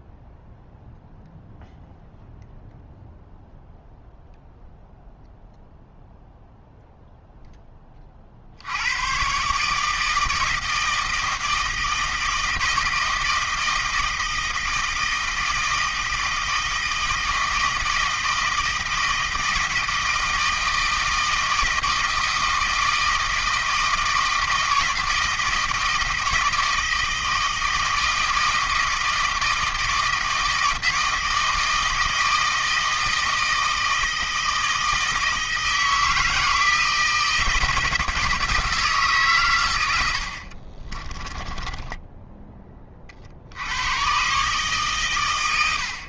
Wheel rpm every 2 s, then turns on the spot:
0, 0, 0, 0, 80, 160, 160, 160, 160, 160, 160, 160, 160, 160, 160, 160, 160, 160, 160, 160, 40, 20, 140.
40-42